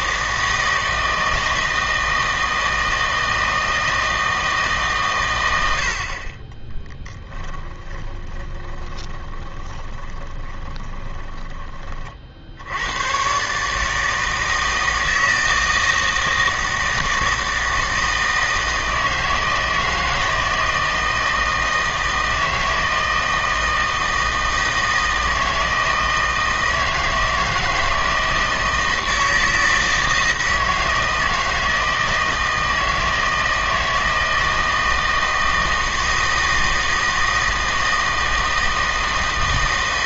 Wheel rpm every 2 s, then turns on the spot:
160, 160, 150, 20, 20, 20, 80, 160, 160, 160, 160, 160, 160, 160, 160, 160, 160, 160, 160, 160.
8-12